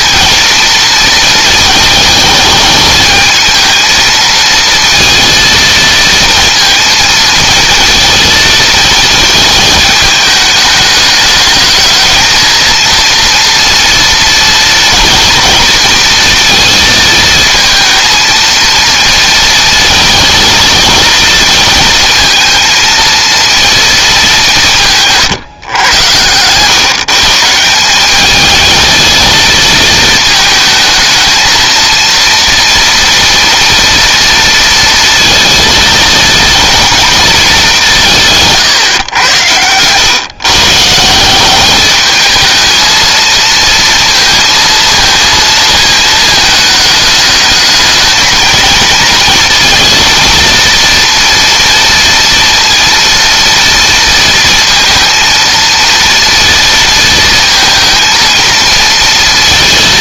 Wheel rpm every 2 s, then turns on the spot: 230, 220, 230, 230, 230, 210, 230, 230, 230, 230, 230, 230, 160, 130, 220, 220, 230, 230, 230, 140, 150, 220, 230, 220, 230, 230, 230, 230, 230, 230.
none